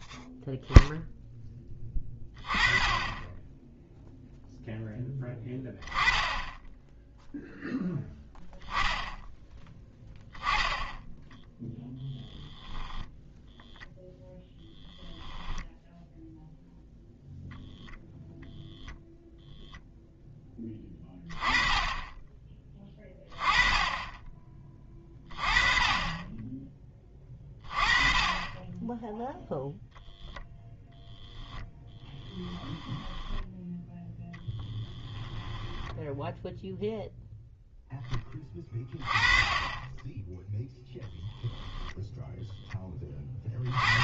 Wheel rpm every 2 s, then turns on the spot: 0, 10, 0, 10, 0, 10, 0, 0, 0, 0, 10, 20, 20, 20, 10, 0, 10, 20, 0, 20, 0, 10.
32-36